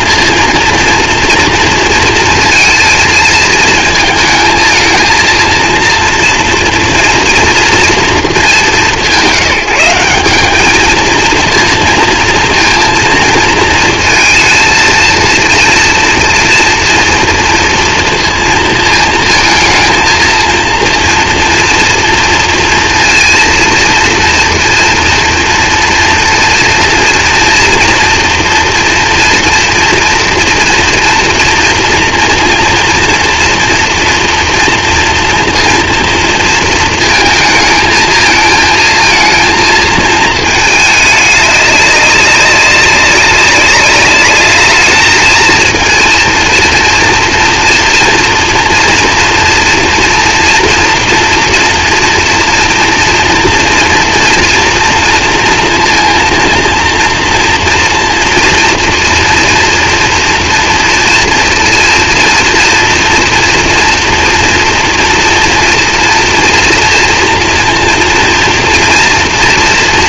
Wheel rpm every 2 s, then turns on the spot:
230, 220, 220, 230, 200, 200, 230, 230, 230, 230, 230, 230, 240, 230, 230, 230, 230, 240, 230, 220, 220, 200, 210, 230, 230, 230, 230, 230, 230, 230, 230, 230, 240, 230, 230.
none